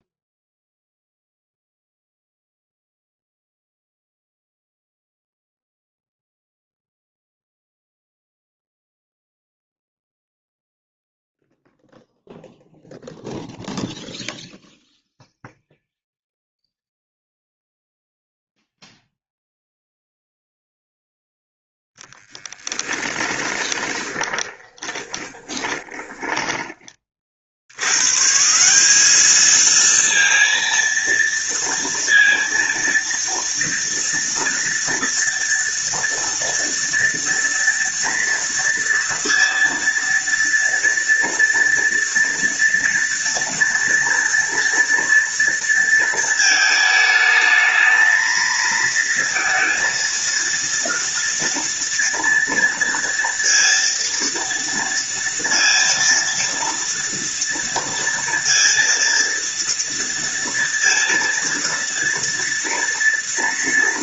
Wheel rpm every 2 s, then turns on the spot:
0, 0, 0, 0, 0, 0, 0, 0, 0, 0, 0, 10, 20, 30, 190, 230, 230, 230, 230, 230, 230, 240, 230, 220, 230, 230, 230, 230, 230, 230, 230, 230.
22-26